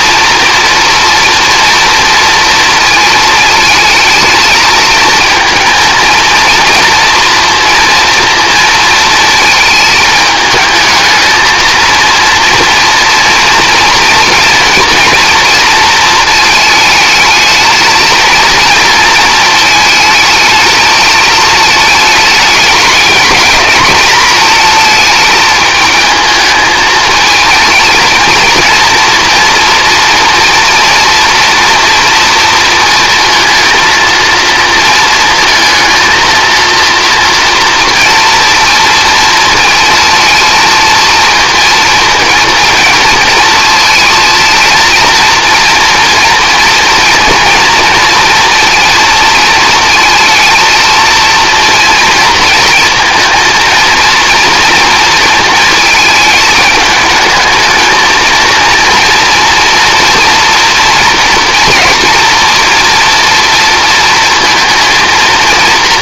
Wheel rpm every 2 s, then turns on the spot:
230, 230, 220, 230, 230, 220, 230, 230, 220, 230, 220, 220, 220, 220, 230, 230, 230, 230, 230, 230, 230, 220, 230, 230, 230, 230, 230, 230, 210, 230, 240, 240, 230.
none